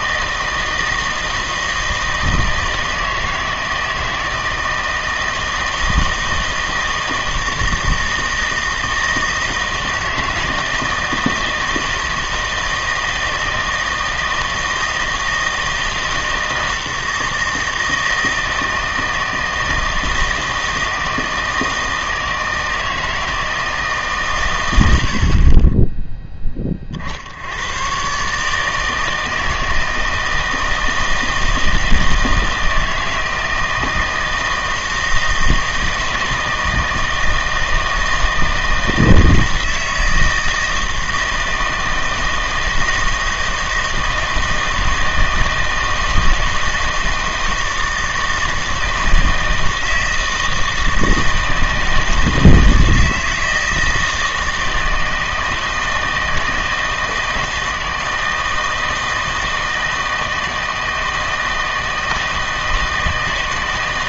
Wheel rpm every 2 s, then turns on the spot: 160, 160, 160, 160, 160, 160, 160, 160, 160, 160, 160, 160, 110, 20, 150, 160, 160, 160, 160, 160, 160, 160, 160, 160, 160, 160, 160, 160, 160, 160, 160, 160.
none